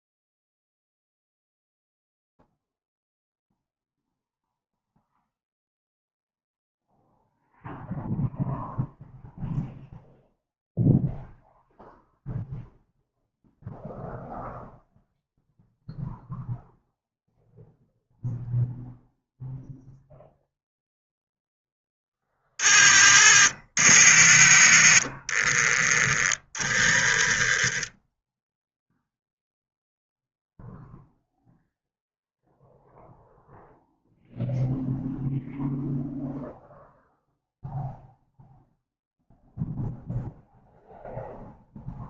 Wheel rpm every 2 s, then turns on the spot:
0, 0, 0, 0, 0, 0, 0, 0, 0, 0, 0, 30, 30, 10, 0, 0, 0, 0, 0, 0, 0.
none